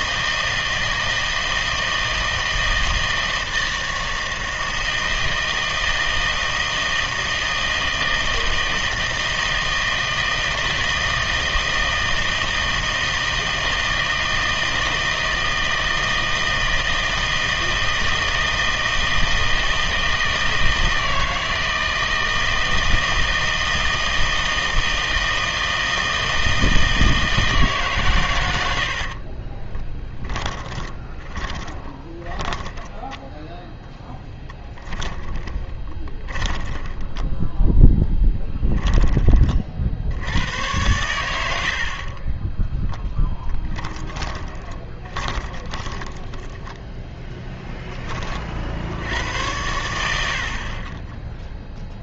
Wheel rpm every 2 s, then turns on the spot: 160, 160, 160, 160, 160, 160, 160, 160, 160, 160, 160, 160, 160, 160, 90, 20, 10, 10, 10, 10, 90, 10, 20, 10, 50, 50.
28-40 42-48